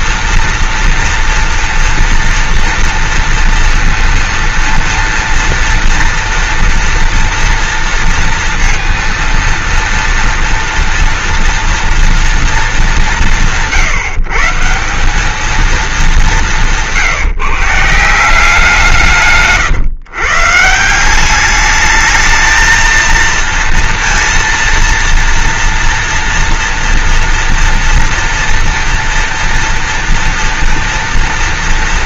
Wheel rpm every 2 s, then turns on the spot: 230, 230, 230, 230, 230, 230, 190, 170, 180, 170, 160, 220, 230, 230, 230, 230.
16-18